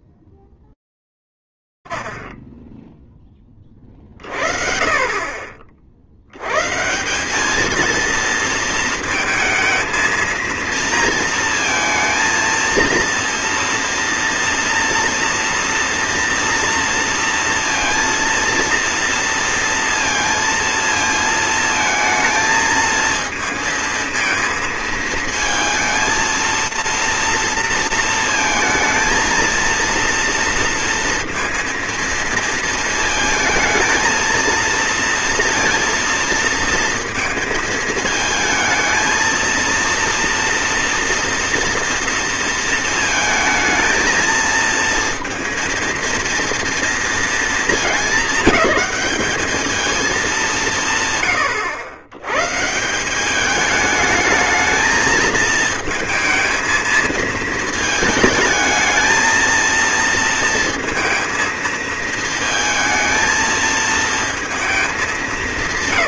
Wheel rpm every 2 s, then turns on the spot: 40, 140, 20, 50, 210, 230, 230, 230, 240, 230, 230, 220, 220, 230, 230, 230, 230, 220, 230, 220, 230, 230, 220, 230, 220, 220, 110, 210, 220, 220, 230, 230, 230.
none